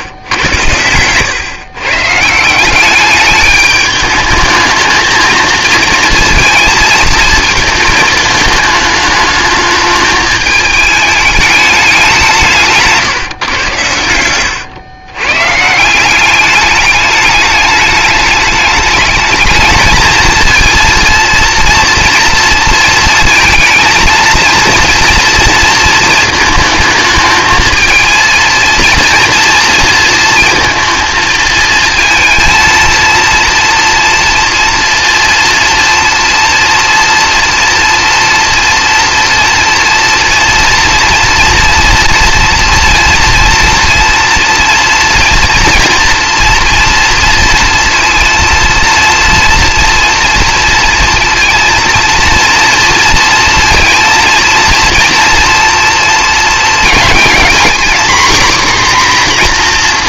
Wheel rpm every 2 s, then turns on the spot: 120, 190, 220, 220, 220, 220, 170, 110, 200, 210, 230, 230, 230, 220, 230, 230, 230, 230, 230, 230, 230, 230, 230, 230, 230, 230, 230, 230, 230, 260.
none